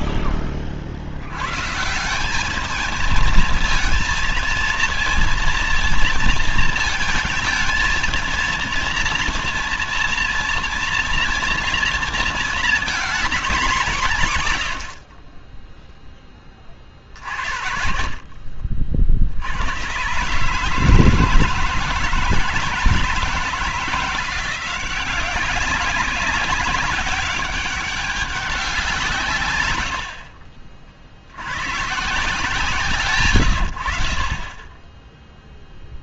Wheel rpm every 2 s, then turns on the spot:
20, 210, 230, 220, 230, 230, 230, 110, 40, 60, 150, 160, 180, 200, 170, 50, 140, 20.
none